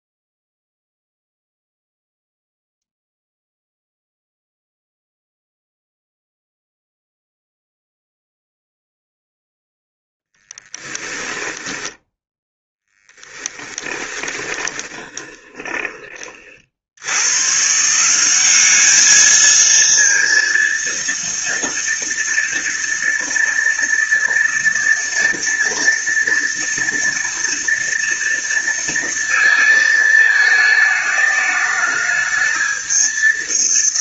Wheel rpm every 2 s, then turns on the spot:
0, 0, 0, 0, 0, 10, 10, 20, 90, 210, 230, 230, 230, 230, 230, 220, 220.
10-12 14-16